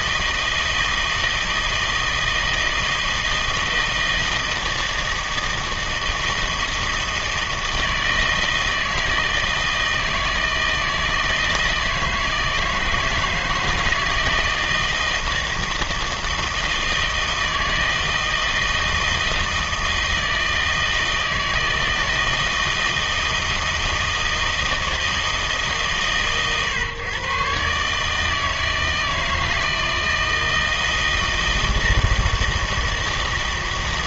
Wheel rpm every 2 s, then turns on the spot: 160, 160, 160, 160, 160, 160, 160, 160, 160, 160, 160, 160, 160, 120, 160, 160, 160.
none